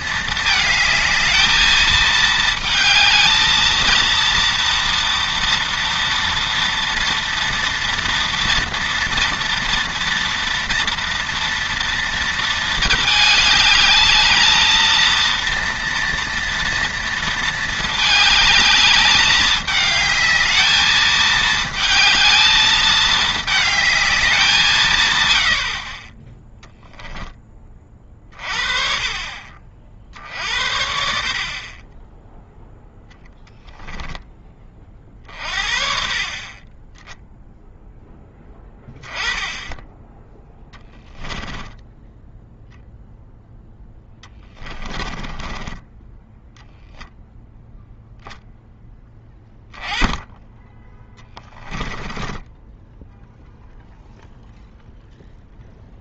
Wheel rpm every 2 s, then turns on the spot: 220, 220, 230, 230, 230, 230, 220, 220, 230, 220, 220, 220, 150, 10, 40, 60, 0, 30, 20, 10, 10, 0, 20, 0, 10, 10, 10, 0.
26-28 40-42 44-46 52-54